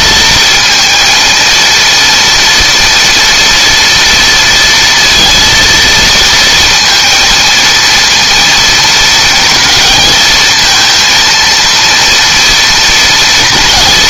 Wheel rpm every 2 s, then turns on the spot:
230, 230, 230, 230, 230, 220, 230.
none